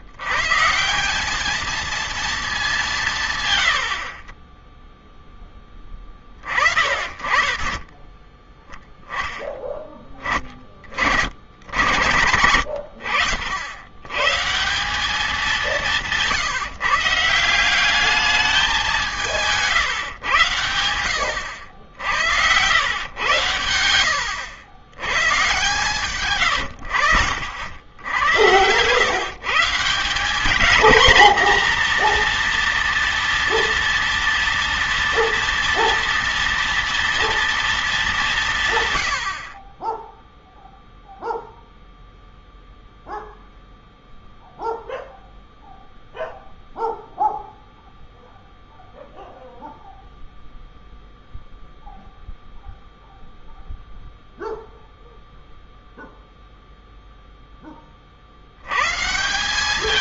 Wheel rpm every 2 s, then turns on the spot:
160, 190, 20, 30, 10, 60, 100, 180, 150, 190, 100, 100, 100, 90, 120, 230, 230, 230, 230, 130, 0, 0, 0, 0, 0, 0, 0, 0, 0, 110.
none